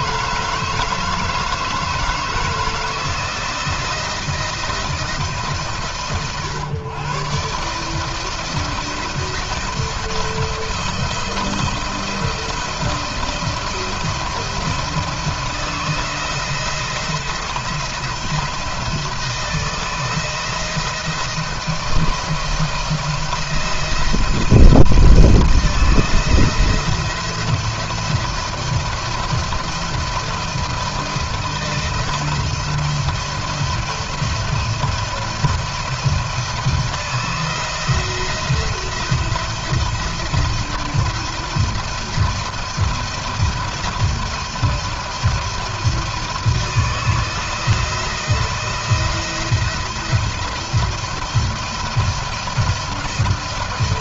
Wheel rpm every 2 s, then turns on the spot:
160, 160, 170, 120, 160, 170, 170, 170, 170, 170, 160, 160, 170, 170, 170, 170, 170, 170, 170, 170, 170, 170, 170, 160, 170, 160, 170.
none